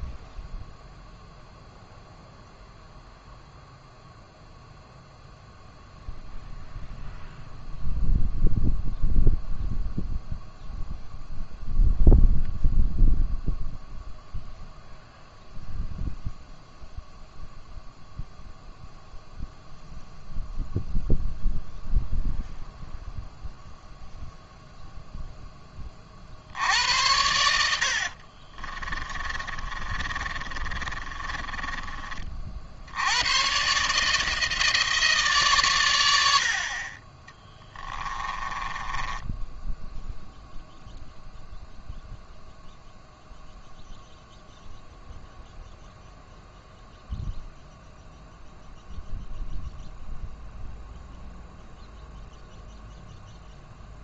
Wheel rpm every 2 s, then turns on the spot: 0, 0, 0, 0, 0, 0, 0, 0, 0, 0, 0, 0, 0, 70, 40, 30, 50, 160, 60, 20, 0, 0, 0, 0, 0, 0, 0.
28-32 38-40